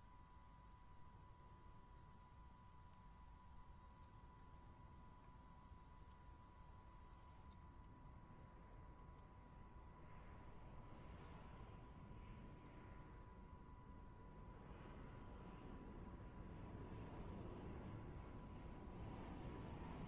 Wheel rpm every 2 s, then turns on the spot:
120, 120, 120, 120, 120, 120, 120, 120, 120, 120.
none